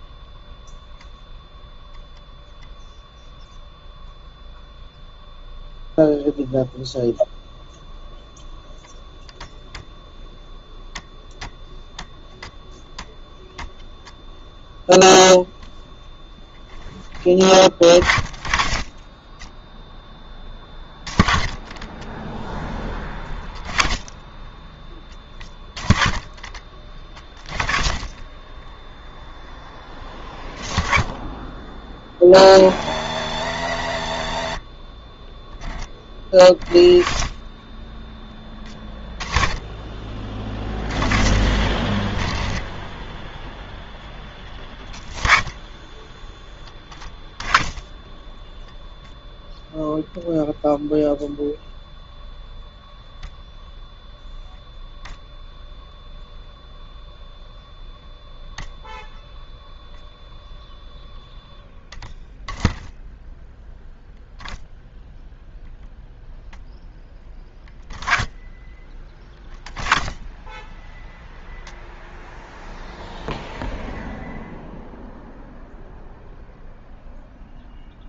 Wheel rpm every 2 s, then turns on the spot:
0, 0, 0, 0, 0, 10, 10, 0, 10, 30, 10, 20, 20, 30, 10, 20, 90, 40, 30, 30, 40, 10, 20, 20, 0, 0, 0, 0, 0, 0, 0, 10, 0, 0, 20, 10, 0, 0, 0.
none